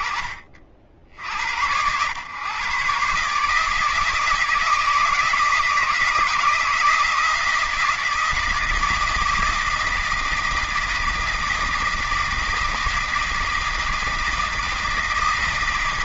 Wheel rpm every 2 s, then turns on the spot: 50, 130, 160, 170, 160, 160, 160, 160.
none